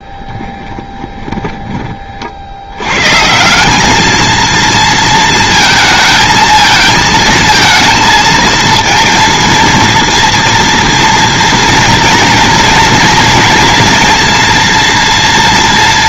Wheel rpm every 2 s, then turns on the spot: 10, 90, 230, 220, 220, 230, 230, 230.
0-2